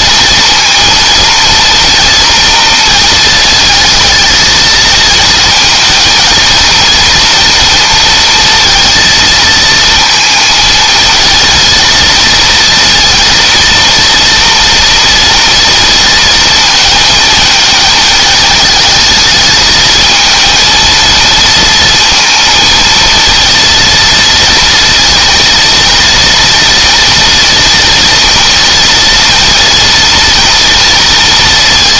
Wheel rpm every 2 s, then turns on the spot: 230, 230, 220, 230, 230, 230, 230, 230, 220, 220, 230, 230, 230, 230, 230, 230.
none